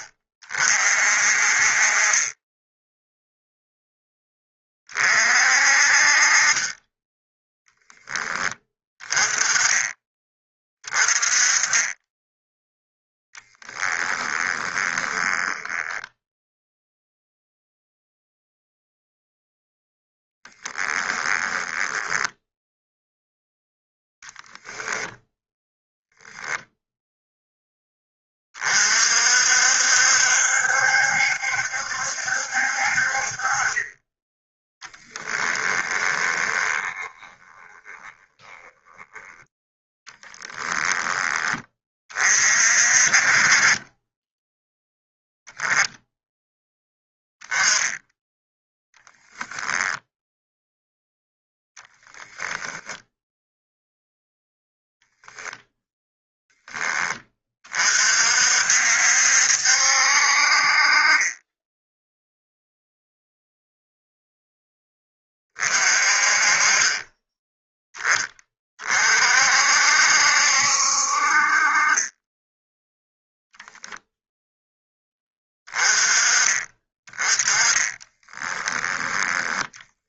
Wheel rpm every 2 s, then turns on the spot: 50, 10, 30, 20, 20, 20, 10, 20, 0, 0, 10, 0, 0, 0, 50, 70, 50, 10, 20, 10, 10, 40, 10, 10, 10, 0, 0, 0, 10, 60, 40, 0, 10, 20, 30, 60, 10, 10, 20, 10.
14-16 20-22 34-40 48-50